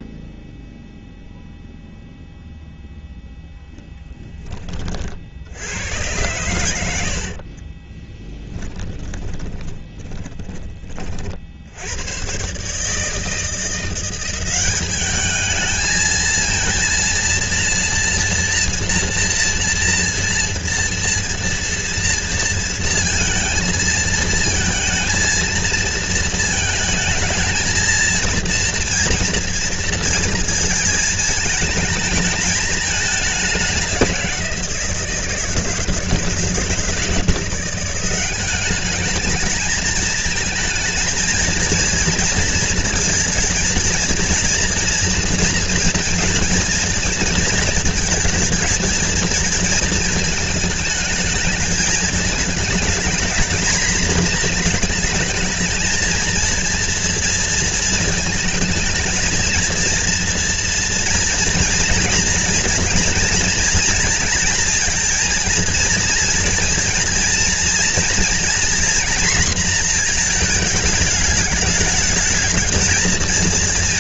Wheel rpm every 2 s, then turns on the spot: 0, 0, 30, 80, 20, 30, 150, 200, 230, 230, 230, 230, 230, 220, 230, 220, 210, 170, 160, 200, 220, 230, 230, 220, 220, 220, 220, 220, 230, 220, 230, 230, 230, 230, 240, 220, 230.
6-10